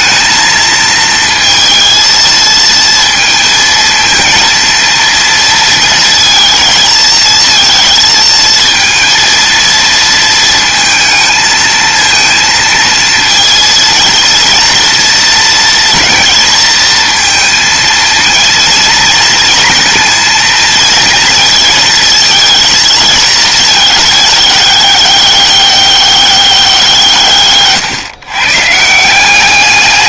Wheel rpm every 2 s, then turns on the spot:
230, 230, 230, 230, 230, 220, 230, 230, 230, 230, 230, 220, 200, 180, 150.
none